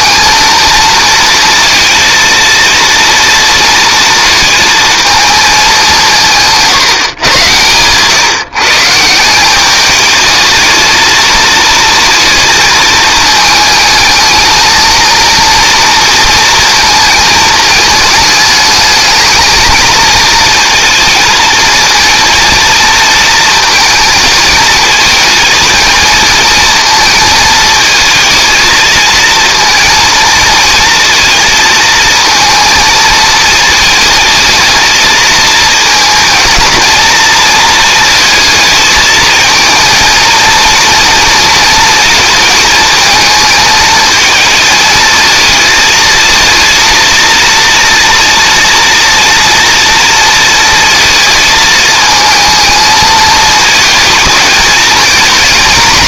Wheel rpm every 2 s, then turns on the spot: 230, 230, 220, 150, 140, 220, 220, 220, 230, 220, 230, 230, 220, 220, 220, 230, 220, 220, 230, 220, 230, 220, 220, 230, 230, 230, 220, 220.
none